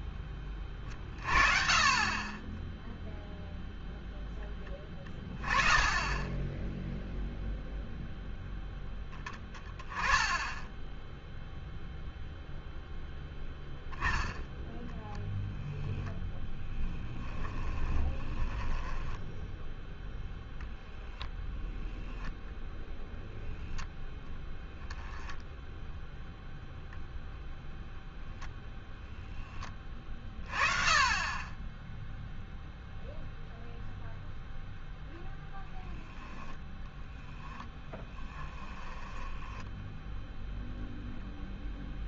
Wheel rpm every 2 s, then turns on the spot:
20, 20, 10, 10, 0, 10, 0, 10, 10, 10, 10, 0, 0, 0, 0, 30, 0, 0, 0, 10, 0.
16-20 38-40